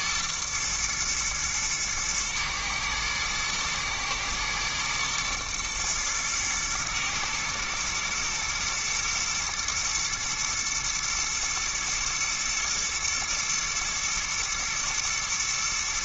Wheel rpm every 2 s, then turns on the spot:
110, 110, 120, 110, 120, 110, 120, 120.
none